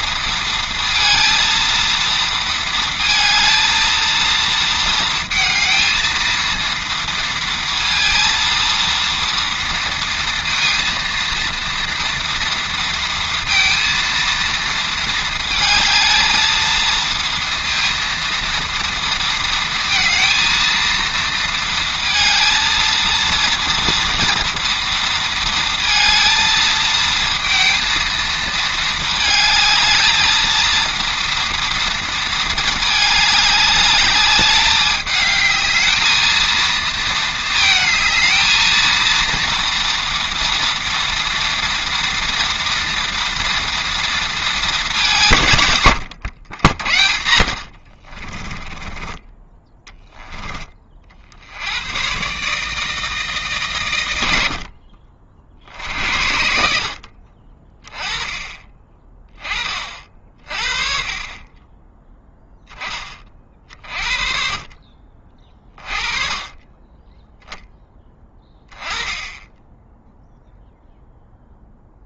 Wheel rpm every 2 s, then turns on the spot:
230, 230, 230, 230, 230, 230, 230, 220, 230, 230, 230, 230, 230, 230, 220, 230, 210, 210, 230, 220, 230, 240, 210, 60, 20, 30, 160, 60, 60, 20, 30, 20, 40, 10, 20, 0.
48-50